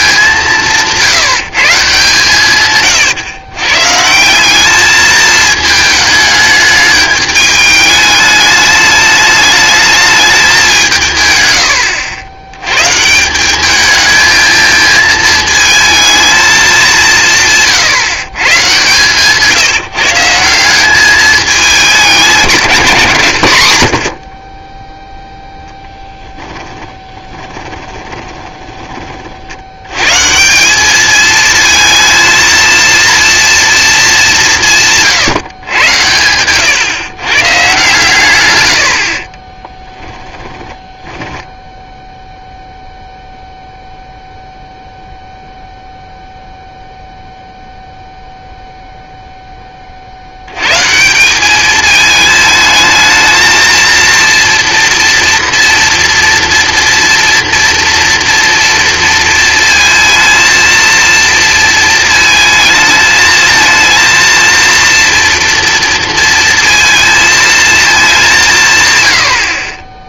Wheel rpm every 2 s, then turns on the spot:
180, 140, 200, 210, 210, 170, 120, 220, 200, 140, 190, 160, 10, 10, 20, 190, 230, 170, 120, 100, 10, 0, 0, 0, 0, 130, 220, 230, 230, 230, 230, 220, 230, 230, 150.
26-30 40-42